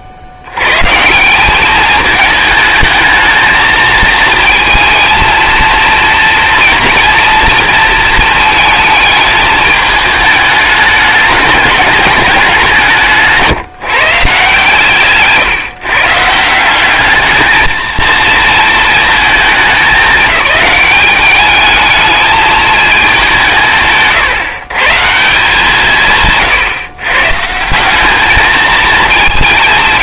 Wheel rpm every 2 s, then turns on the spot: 100, 220, 230, 230, 220, 210, 180, 150, 180, 230, 210, 220, 140, 130, 220.
none